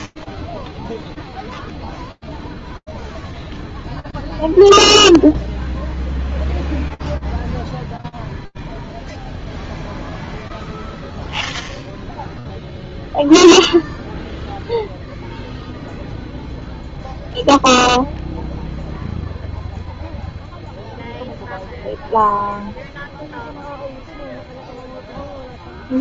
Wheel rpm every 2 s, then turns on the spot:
0, 0, 0, 0, 0, 0, 0, 0, 0, 0, 0, 0, 10.
24-26